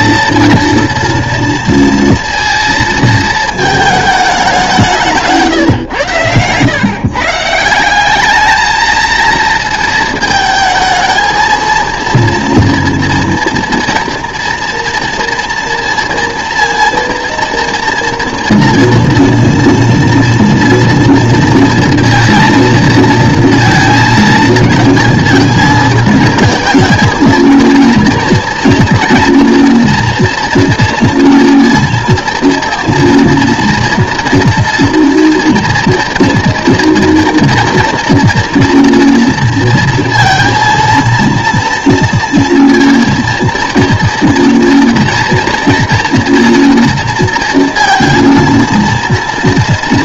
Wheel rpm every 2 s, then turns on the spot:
240, 230, 200, 110, 220, 220, 230, 230, 230, 230, 230, 220, 220, 220, 230, 230, 230, 240, 230, 230, 230, 230, 230, 230, 230.
none